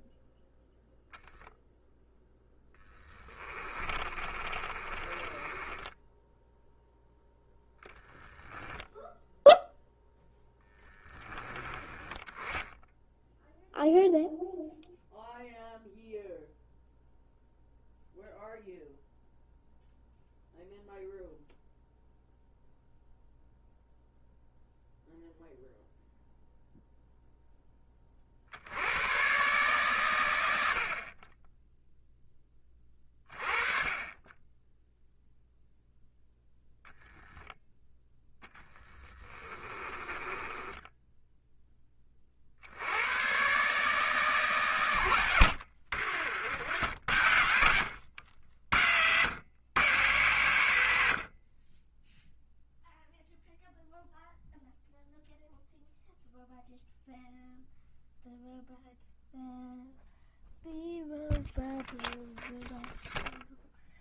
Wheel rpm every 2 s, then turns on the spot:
0, 10, 20, 0, 0, 10, 0, 0, 0, 0, 0, 0, 0, 0, 100, 50, 20, 10, 10, 10, 10, 90, 120, 80, 90, 110, 0, 0, 0, 0, 0, 0.
2-6 38-42